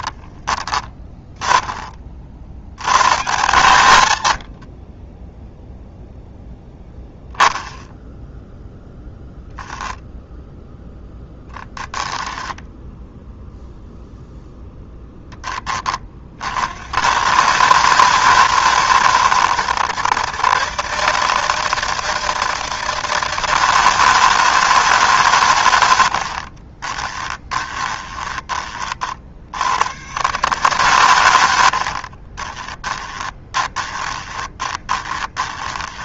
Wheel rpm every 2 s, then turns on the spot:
20, 100, 40, 0, 0, 0, 0, 0, 70, 110, 150, 160, 150, 20, 40, 140, 20, 20.
4-6 26-28 32-36